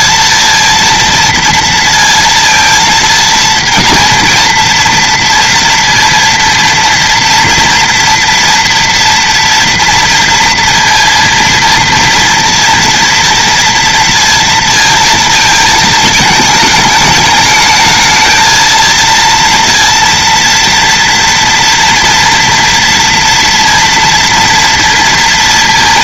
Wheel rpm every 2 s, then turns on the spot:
230, 230, 230, 230, 230, 230, 230, 230, 220, 230, 230, 240, 230.
none